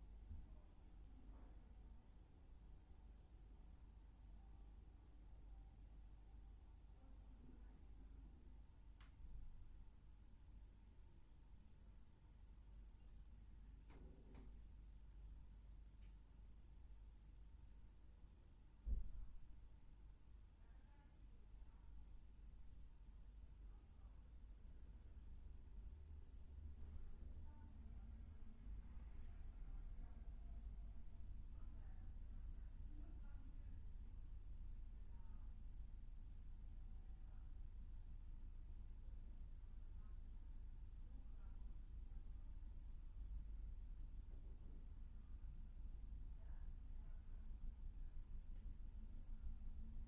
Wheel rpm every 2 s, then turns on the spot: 0, 0, 0, 0, 0, 0, 0, 0, 0, 0, 0, 0, 0, 0, 0, 0, 0, 0, 0, 0, 0, 0, 0, 0, 0.
none